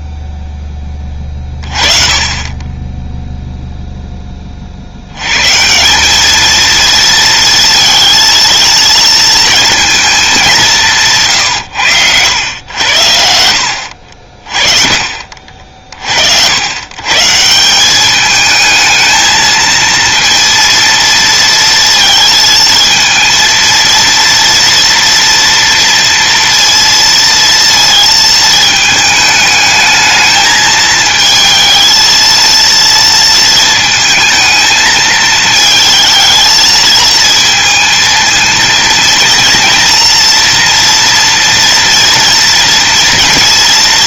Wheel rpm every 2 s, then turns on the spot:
10, 10, 80, 230, 230, 180, 90, 40, 130, 220, 230, 230, 230, 230, 220, 220, 230, 220, 220, 230, 230, 230.
none